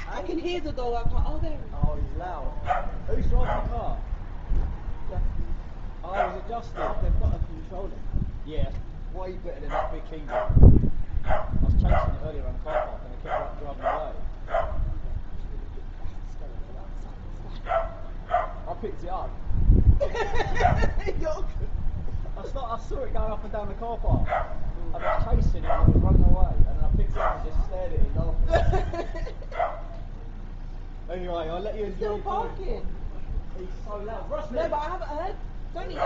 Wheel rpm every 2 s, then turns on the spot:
10, 0, 0, 0, 0, 0, 0, 0, 0, 0, 0, 0, 0, 0, 0, 0, 0, 0.
none